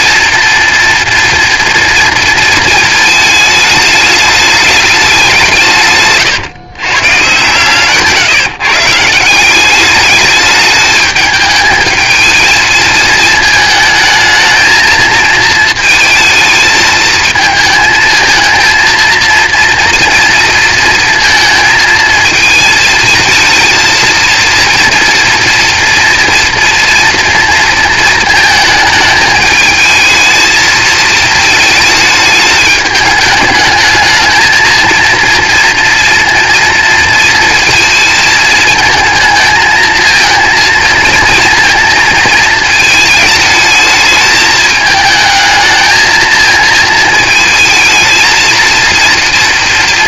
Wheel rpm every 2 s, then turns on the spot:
230, 220, 210, 130, 150, 210, 220, 220, 220, 230, 230, 220, 230, 230, 220, 220, 210, 230, 230, 220, 230, 220, 220, 220, 230.
none